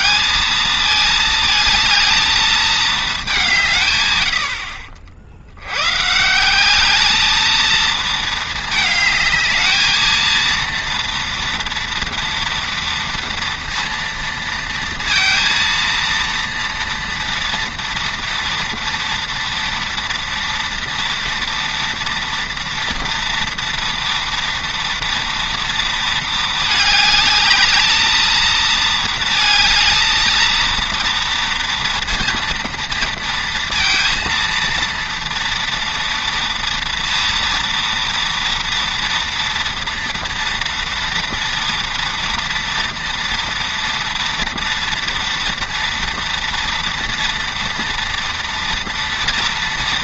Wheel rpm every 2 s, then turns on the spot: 220, 220, 70, 190, 220, 230, 230, 230, 230, 230, 230, 230, 230, 220, 220, 230, 230, 230, 230, 230, 230, 230, 230, 230, 230.
none